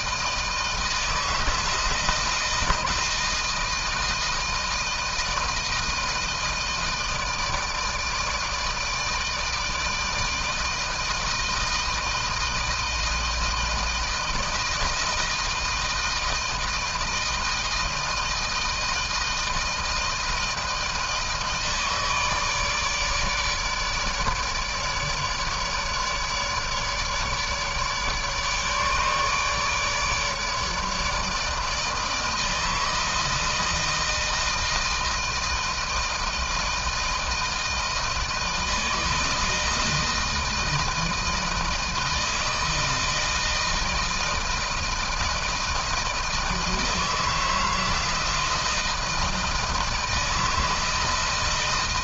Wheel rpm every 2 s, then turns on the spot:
160, 160, 160, 160, 160, 160, 160, 160, 160, 160, 160, 150, 150, 150, 150, 150, 160, 160, 160, 160, 160, 160, 160, 160, 160, 160.
none